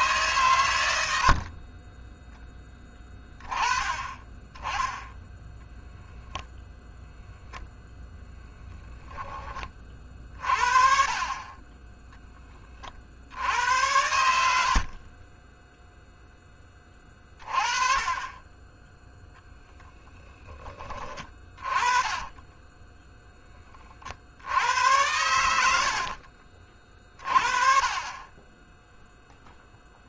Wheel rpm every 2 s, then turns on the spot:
90, 10, 10, 0, 10, 40, 40, 50, 20, 10, 20, 10, 90, 40, 0.
14-16 22-24